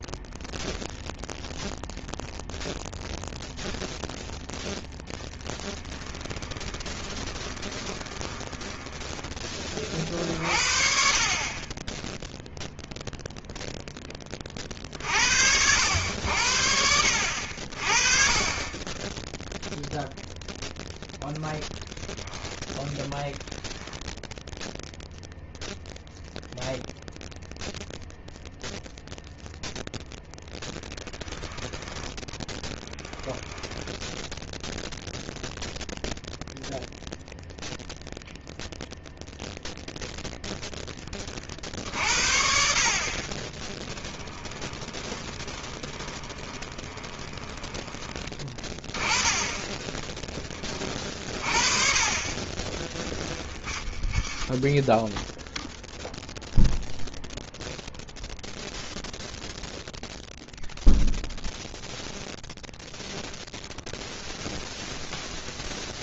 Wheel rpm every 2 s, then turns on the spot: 0, 0, 0, 10, 20, 50, 0, 20, 80, 30, 0, 10, 0, 0, 0, 0, 20, 0, 0, 0, 0, 60, 10, 20, 20, 20, 30, 20, 0, 0, 0, 0, 0.
6-10 32-34 44-48 52-56